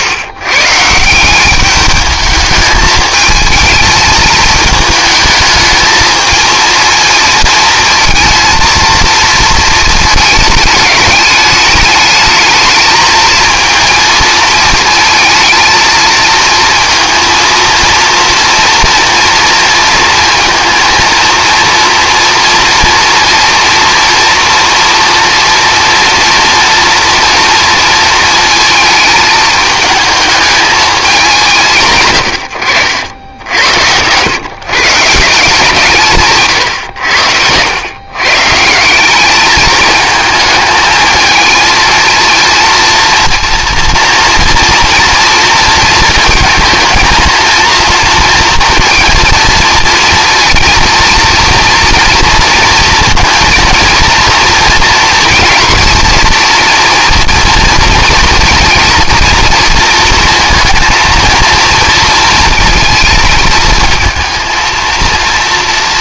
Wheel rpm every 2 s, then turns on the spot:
140, 210, 220, 220, 230, 210, 220, 220, 230, 230, 230, 230, 230, 230, 220, 210, 80, 130, 130, 160, 220, 230, 230, 230, 230, 230, 230, 240, 230, 230, 230, 230, 230.
none